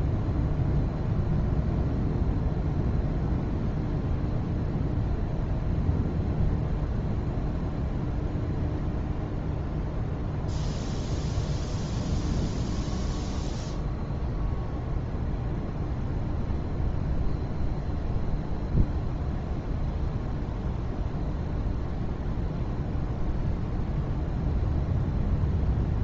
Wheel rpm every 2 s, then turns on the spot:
0, 0, 0, 0, 0, 0, 0, 0, 0, 0, 0, 0, 0.
none